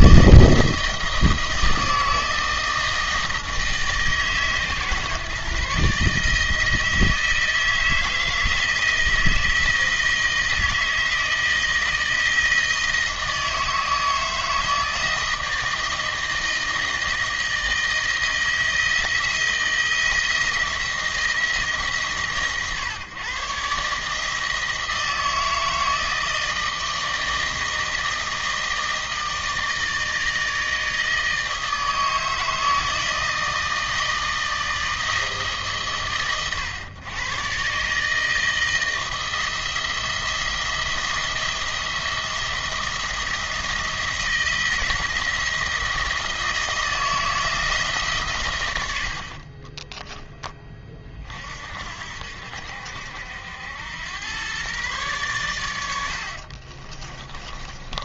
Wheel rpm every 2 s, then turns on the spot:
160, 160, 140, 160, 160, 160, 160, 160, 160, 160, 170, 120, 160, 160, 160, 160, 160, 160, 110, 160, 170, 170, 160, 160, 90, 30, 70, 120, 40.
56-58